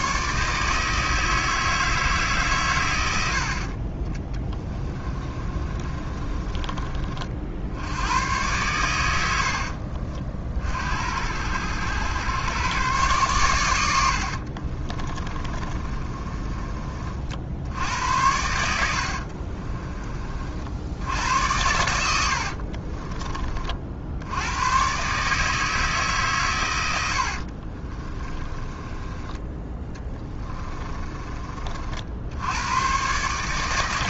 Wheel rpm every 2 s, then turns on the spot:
160, 120, 20, 30, 110, 70, 120, 30, 40, 80, 60, 50, 120, 100, 20, 30, 120.
4-6 14-16 18-20 22-24 28-32